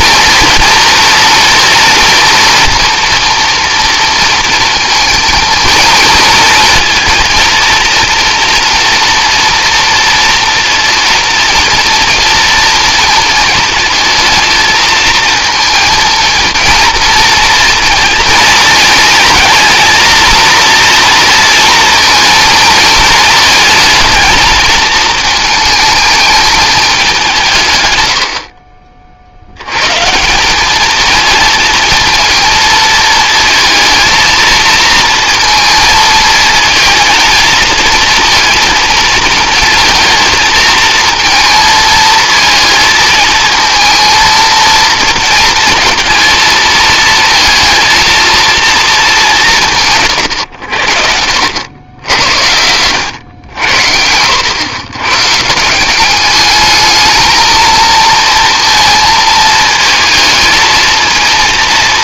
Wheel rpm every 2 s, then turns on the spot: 230, 230, 230, 230, 230, 230, 230, 230, 230, 230, 230, 220, 220, 190, 40, 220, 220, 230, 220, 220, 230, 230, 230, 220, 210, 60, 100, 110, 220, 220, 230.
50-52